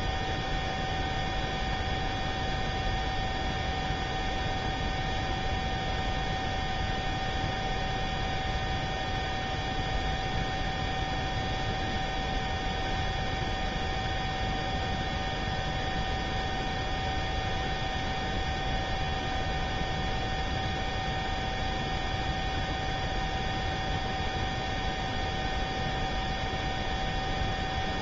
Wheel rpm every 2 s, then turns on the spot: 0, 0, 0, 0, 0, 0, 0, 0, 0, 0, 0, 0, 0, 0.
none